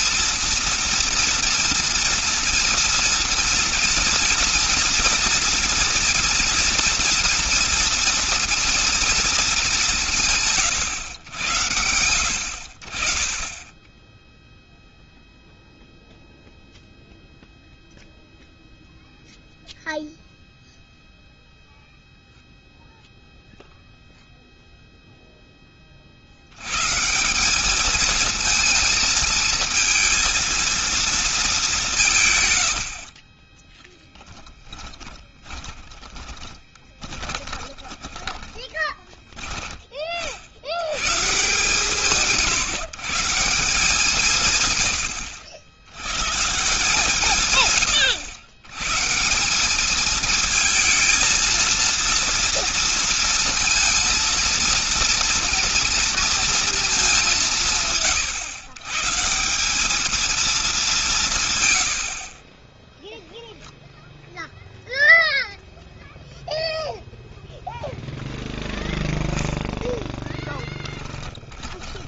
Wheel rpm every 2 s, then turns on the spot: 230, 230, 240, 230, 230, 120, 40, 0, 0, 0, 0, 0, 0, 140, 230, 230, 50, 10, 20, 20, 120, 160, 90, 150, 130, 220, 230, 230, 210, 140, 190, 10, 0, 0, 0, 10.
32-34 36-38 62-64 70-72